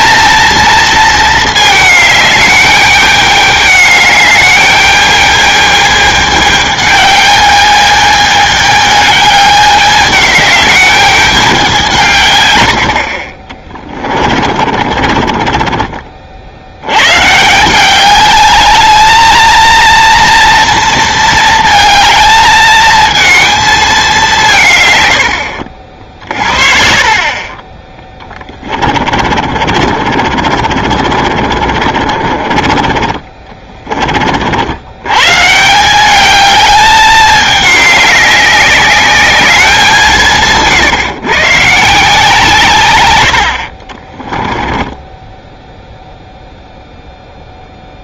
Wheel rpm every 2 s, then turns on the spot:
230, 210, 210, 210, 210, 210, 90, 40, 80, 210, 230, 220, 150, 50, 20, 50, 40, 70, 210, 200, 140, 140, 10, 0.
14-16 28-34 40-42 44-46